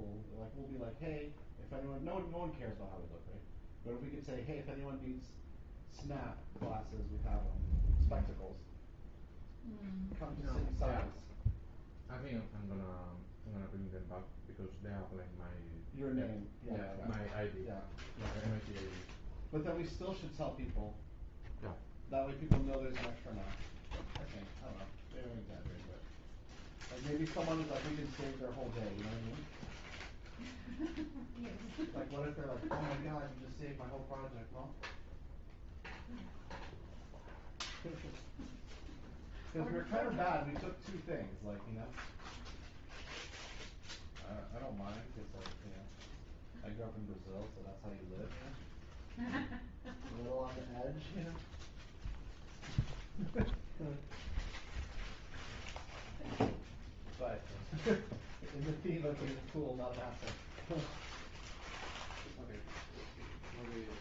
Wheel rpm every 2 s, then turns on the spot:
0, 0, 0, 0, 0, 0, 0, 0, 0, 0, 0, 0, 0, 0, 0, 0, 0, 0, 0, 0, 0, 0, 0, 0, 0, 0, 0, 0, 0, 0, 0, 0.
none